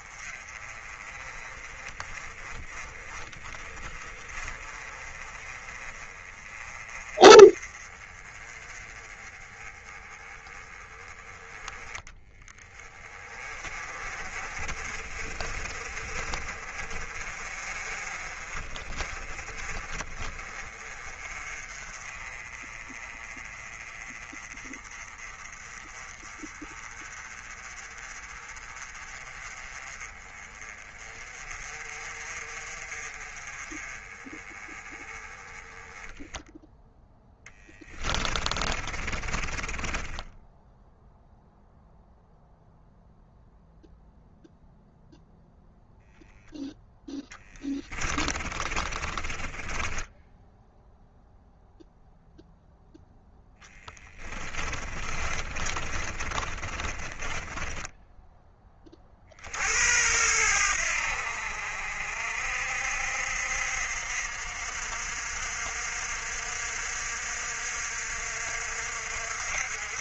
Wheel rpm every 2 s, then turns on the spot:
30, 20, 30, 30, 20, 20, 20, 40, 40, 30, 30, 30, 30, 30, 30, 30, 40, 30, 10, 30, 0, 0, 0, 10, 20, 0, 0, 30, 30, 20, 80, 60, 60, 60, 60.
38-40 48-50 54-58